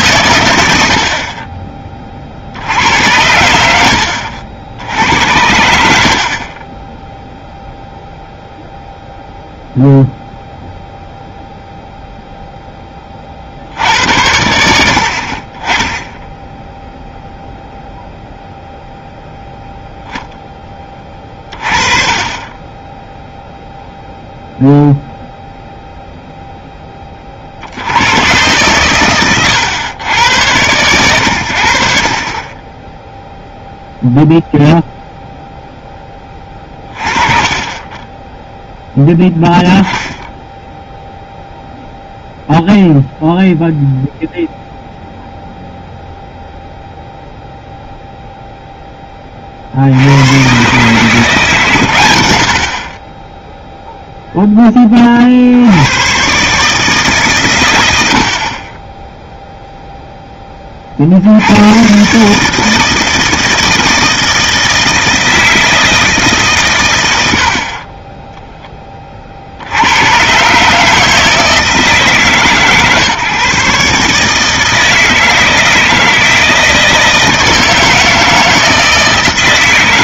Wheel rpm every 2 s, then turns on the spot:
70, 100, 90, 20, 0, 0, 20, 70, 0, 0, 10, 10, 0, 10, 120, 100, 10, 0, 20, 0, 0, 0, 0, 0, 10, 140, 40, 20, 150, 20, 60, 160, 160, 110, 20, 150, 140, 160, 160, 160.
none